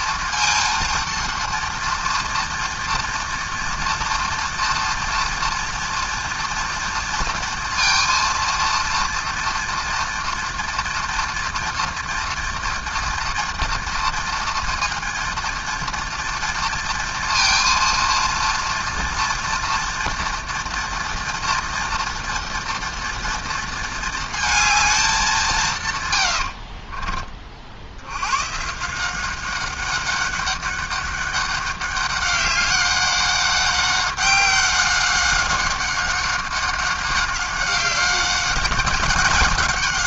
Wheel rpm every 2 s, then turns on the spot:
230, 230, 230, 230, 230, 230, 230, 230, 230, 230, 230, 240, 220, 60, 140, 200, 200, 190, 190, 200.
26-28